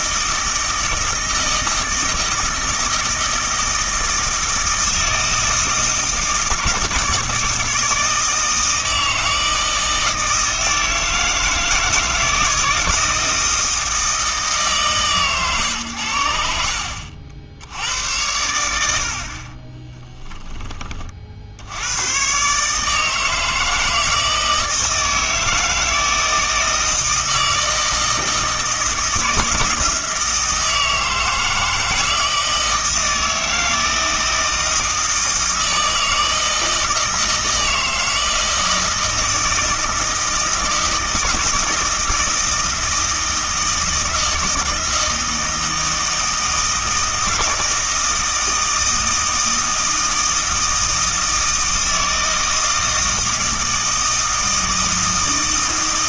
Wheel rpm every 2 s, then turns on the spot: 160, 160, 160, 160, 160, 160, 160, 140, 70, 80, 20, 150, 160, 160, 160, 160, 160, 160, 160, 160, 160, 160, 160, 160, 160, 160, 160, 160.
none